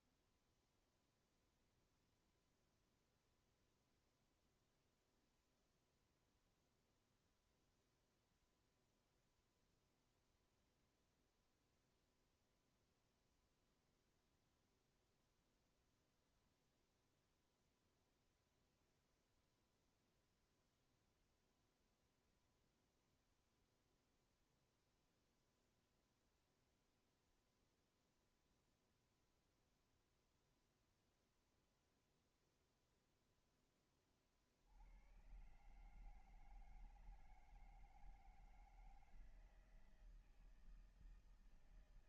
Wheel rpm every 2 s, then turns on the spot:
0, 0, 0, 0, 0, 0, 0, 0, 0, 0, 0, 0, 0, 0, 0, 0, 0, 80, 160, 160, 160.
none